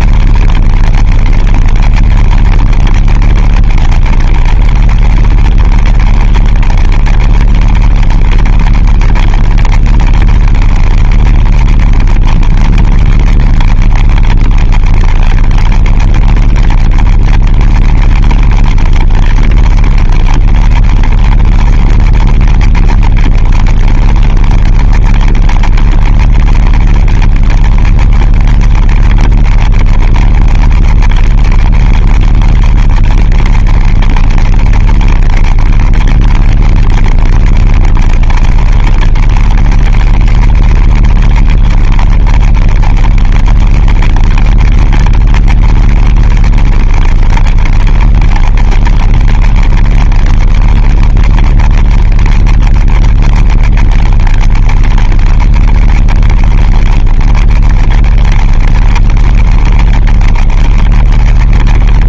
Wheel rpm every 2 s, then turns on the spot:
40, 30, 30, 30, 30, 30, 30, 30, 30, 20, 20, 30, 30, 30, 30, 30, 30, 30, 30, 30, 30, 30, 30, 30, 30, 30, 30, 30, 30, 30, 30.
none